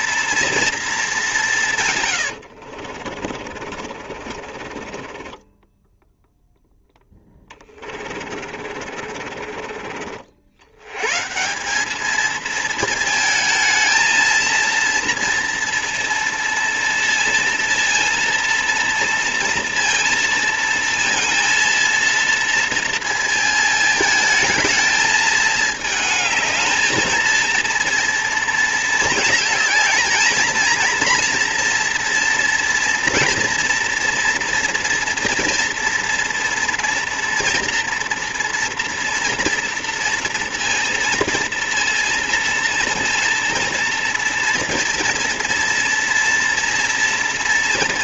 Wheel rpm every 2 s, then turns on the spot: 230, 60, 40, 0, 50, 90, 230, 230, 230, 230, 230, 230, 220, 220, 230, 230, 230, 230, 230, 230, 230, 230, 230, 230.
2-6 8-10